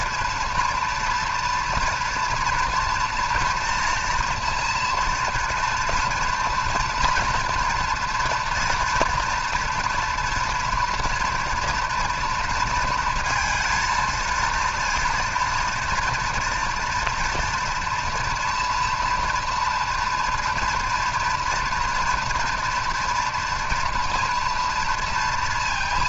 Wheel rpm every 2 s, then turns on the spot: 230, 230, 230, 230, 230, 230, 230, 230, 230, 230, 230, 230, 240.
none